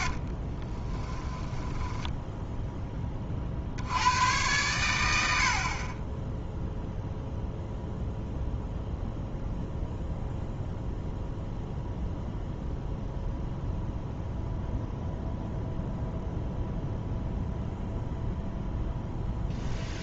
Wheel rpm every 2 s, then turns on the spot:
20, 10, 100, 0, 0, 0, 0, 0, 0, 0.
0-2